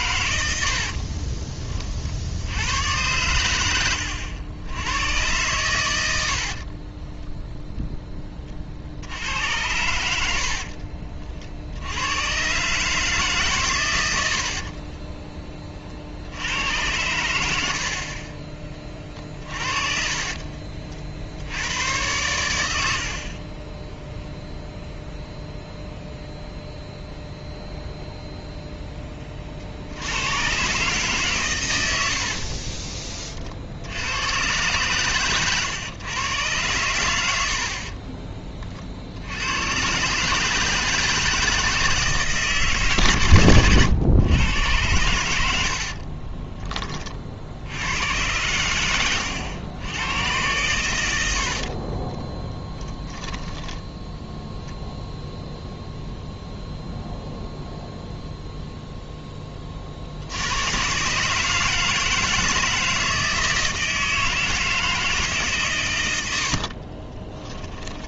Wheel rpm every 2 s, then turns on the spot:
60, 100, 90, 50, 40, 60, 130, 50, 90, 20, 40, 100, 0, 0, 0, 120, 40, 120, 110, 40, 160, 150, 110, 30, 90, 120, 20, 0, 0, 0, 100, 160, 160, 50.
0-2 6-8 10-12 32-34 52-54 66-68